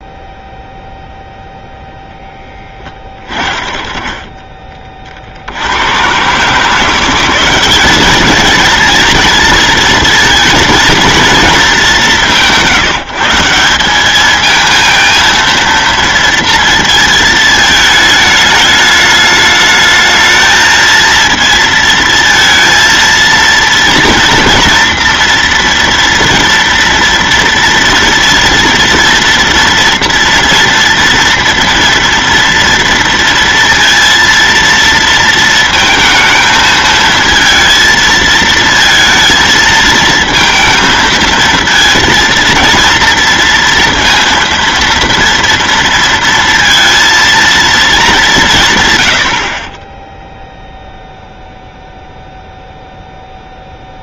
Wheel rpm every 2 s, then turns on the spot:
0, 20, 20, 160, 220, 230, 160, 230, 230, 210, 220, 230, 240, 230, 230, 240, 230, 230, 220, 220, 230, 230, 230, 230, 130, 0, 0.
none